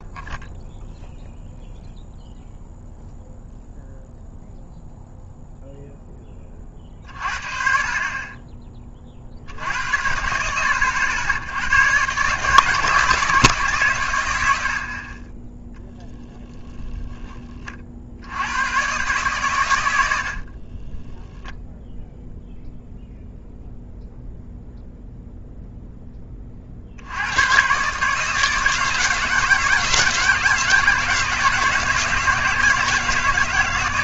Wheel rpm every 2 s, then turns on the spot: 0, 0, 0, 40, 30, 90, 150, 80, 0, 110, 10, 0, 0, 50, 160, 160, 160.
20-22